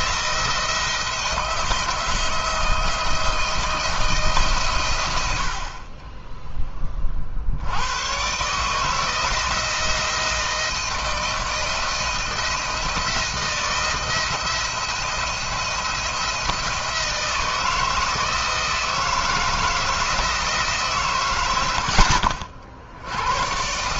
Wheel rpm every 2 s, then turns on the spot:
170, 170, 130, 20, 140, 170, 160, 170, 170, 160, 150, 70.
none